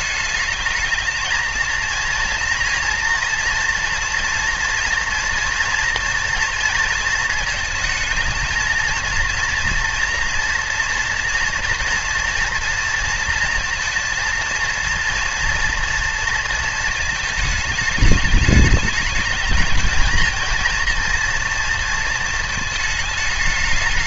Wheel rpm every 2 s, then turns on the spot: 220, 230, 230, 230, 230, 230, 230, 230, 220, 210, 230, 220.
none